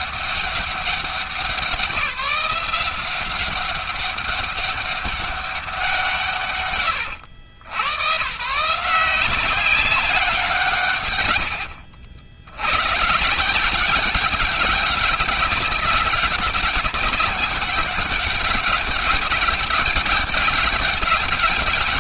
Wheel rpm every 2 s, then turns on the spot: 190, 180, 200, 100, 170, 120, 140, 200, 200, 190, 200.
none